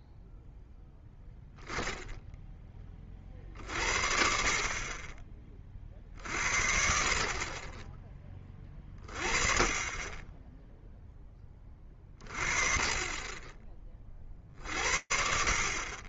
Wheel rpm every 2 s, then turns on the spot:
0, 30, 40, 60, 20, 10, 30, 50.
none